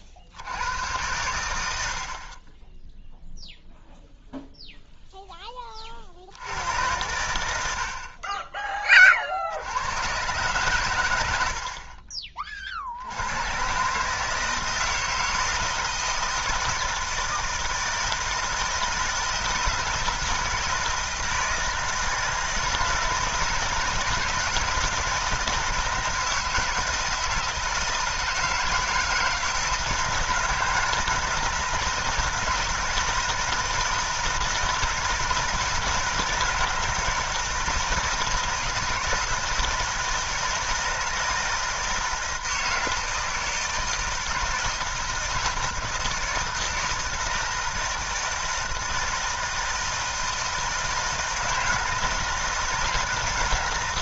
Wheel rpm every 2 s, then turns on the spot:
90, 10, 0, 90, 20, 120, 50, 160, 160, 160, 160, 160, 170, 160, 160, 160, 160, 160, 160, 160, 160, 160, 160, 160, 160, 160, 160.
none